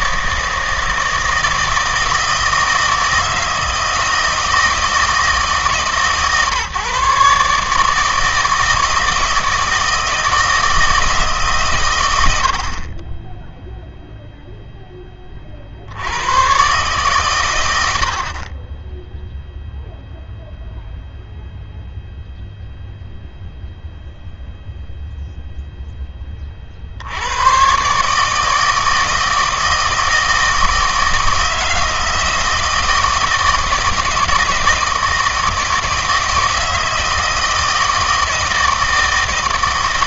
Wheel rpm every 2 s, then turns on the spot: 160, 160, 160, 140, 160, 160, 60, 0, 130, 20, 0, 0, 0, 50, 160, 160, 160, 160, 160, 160.
none